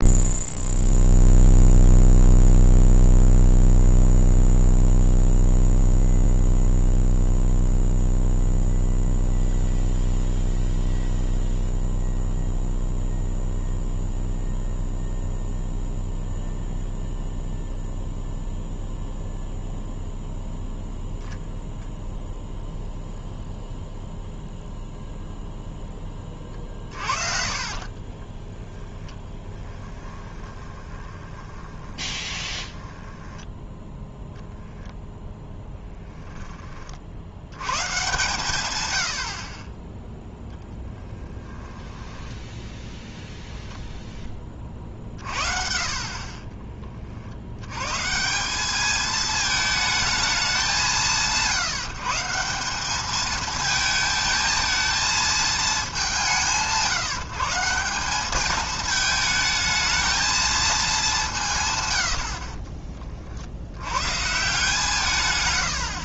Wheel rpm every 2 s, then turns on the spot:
0, 0, 0, 0, 0, 0, 0, 0, 0, 0, 0, 0, 0, 40, 10, 20, 10, 0, 30, 110, 10, 0, 40, 30, 200, 190, 200, 220, 160, 220, 210, 30, 140.
26-34 40-42 44-46 62-64